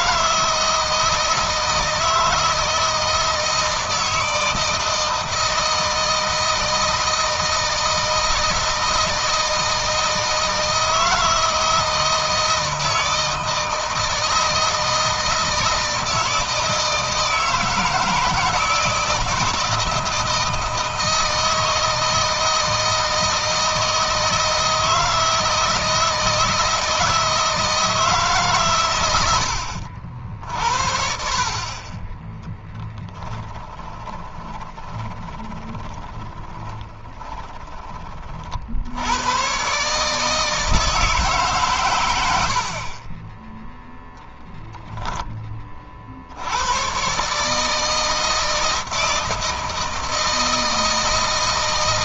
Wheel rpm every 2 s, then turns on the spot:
160, 160, 160, 160, 160, 160, 160, 160, 160, 160, 160, 160, 160, 160, 120, 60, 10, 20, 20, 60, 160, 50, 10, 100, 160, 160.
32-38